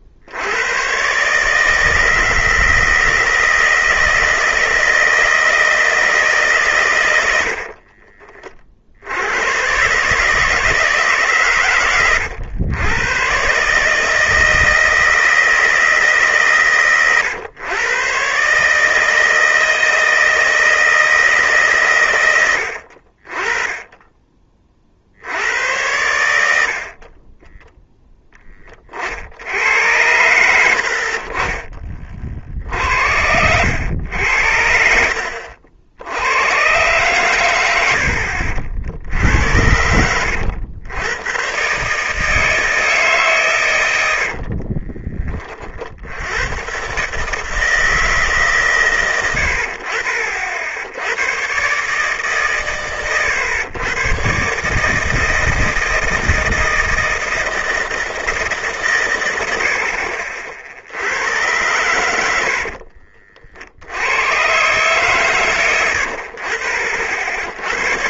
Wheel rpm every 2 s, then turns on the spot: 110, 160, 160, 130, 40, 150, 100, 160, 130, 150, 160, 80, 40, 60, 30, 80, 60, 70, 110, 60, 90, 160, 50, 120, 140, 70, 120, 140, 160, 140, 60, 60, 130, 50.
44-46